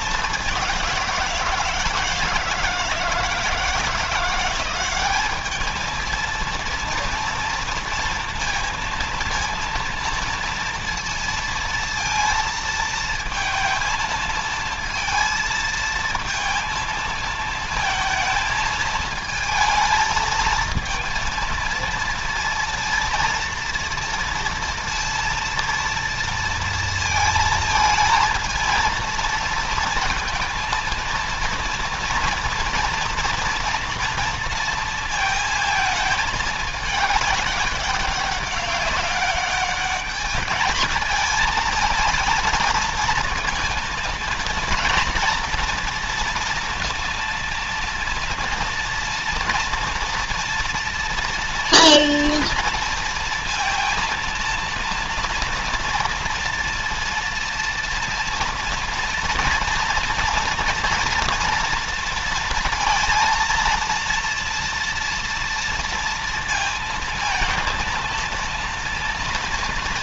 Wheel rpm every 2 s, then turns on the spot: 190, 160, 180, 230, 230, 230, 230, 220, 220, 230, 230, 230, 230, 230, 230, 230, 230, 230, 220, 200, 210, 230, 230, 230, 230, 230, 230, 230, 230, 230, 230, 230, 230, 230, 230.
none